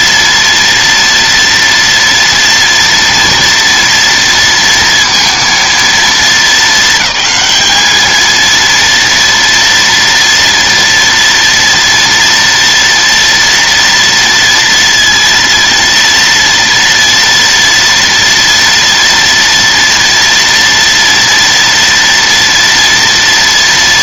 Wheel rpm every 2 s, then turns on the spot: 230, 230, 230, 220, 230, 230, 230, 230, 230, 230, 230, 240.
none